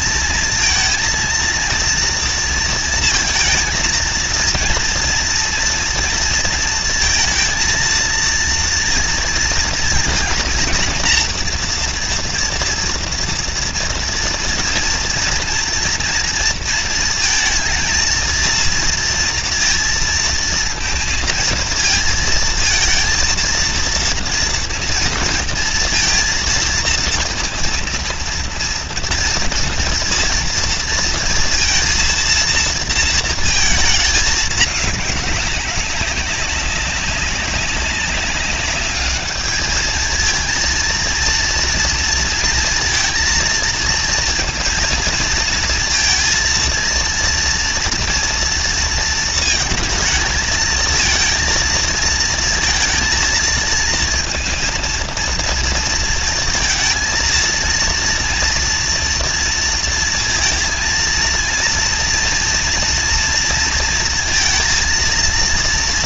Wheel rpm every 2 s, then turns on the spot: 230, 230, 230, 230, 230, 230, 240, 230, 230, 230, 230, 230, 230, 230, 230, 230, 230, 200, 190, 210, 230, 230, 230, 230, 230, 220, 230, 230, 230, 230, 230, 230, 230.
none